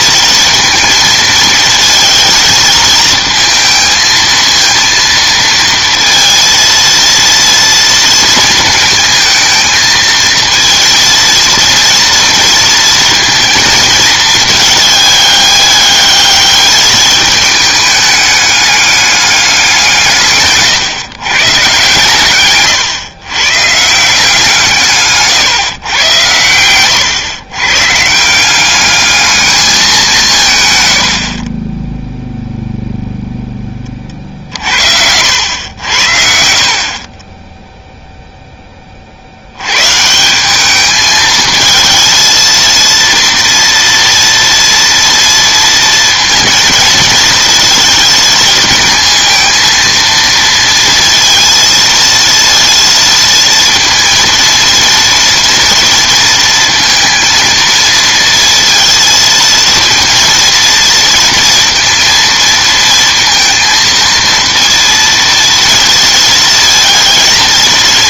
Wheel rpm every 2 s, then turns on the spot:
220, 220, 230, 230, 220, 230, 230, 210, 210, 210, 130, 120, 160, 100, 190, 140, 0, 60, 60, 10, 190, 230, 230, 230, 220, 230, 230, 230, 230, 230, 230, 230, 230, 220.
none